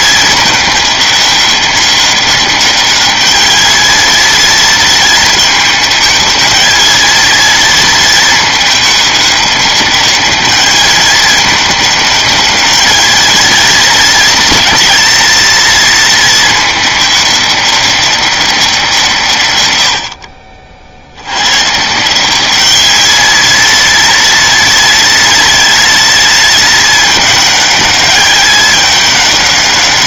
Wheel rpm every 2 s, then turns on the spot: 210, 200, 230, 220, 220, 210, 210, 230, 220, 190, 60, 200, 230, 220, 210.
none